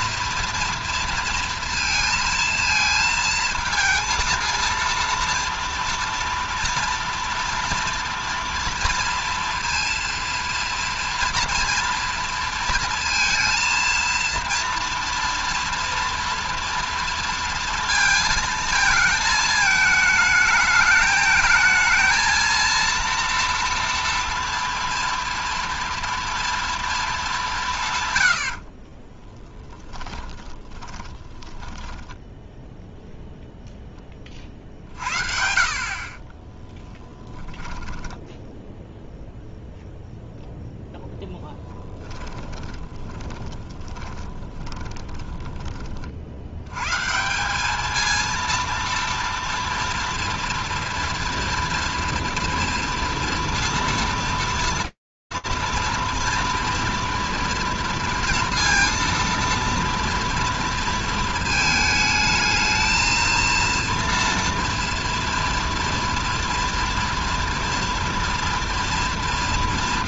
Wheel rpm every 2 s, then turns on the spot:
230, 230, 230, 230, 230, 230, 230, 230, 230, 220, 220, 230, 240, 230, 70, 20, 0, 40, 20, 10, 0, 20, 20, 90, 230, 230, 230, 230, 230, 230, 230, 220, 230, 230, 230.
30-32 36-40 42-46